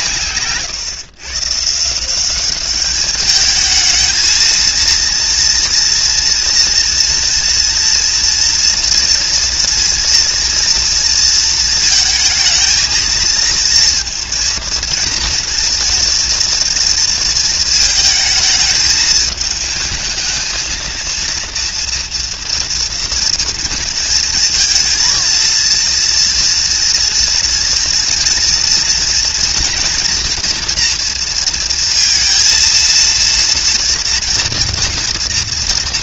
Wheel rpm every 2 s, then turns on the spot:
140, 210, 230, 230, 230, 230, 220, 230, 230, 220, 230, 230, 230, 230, 230, 230, 230, 230.
none